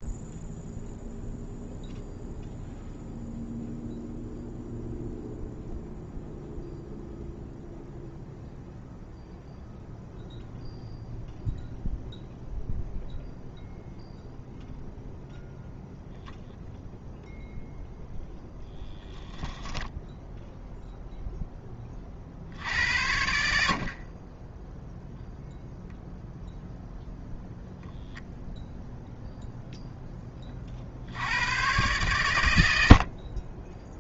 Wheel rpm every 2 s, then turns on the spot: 0, 0, 0, 0, 0, 0, 0, 0, 0, 0, 0, 80, 0, 0, 0, 70, 70.
none